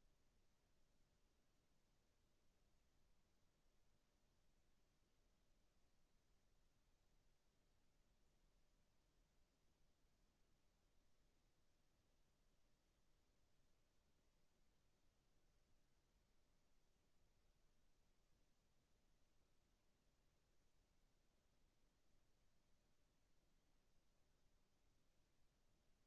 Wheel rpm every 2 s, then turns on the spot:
0, 0, 0, 0, 0, 0, 0, 0, 0, 0, 0, 0, 0.
none